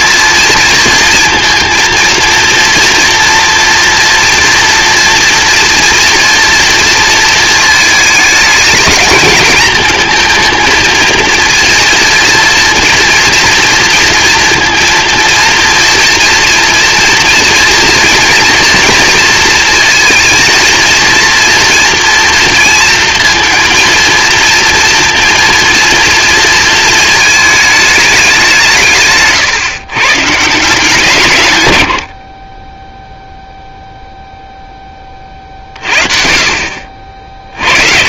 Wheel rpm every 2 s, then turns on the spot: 230, 230, 230, 230, 230, 220, 230, 230, 230, 230, 230, 230, 230, 220, 160, 160, 10, 10, 40.
none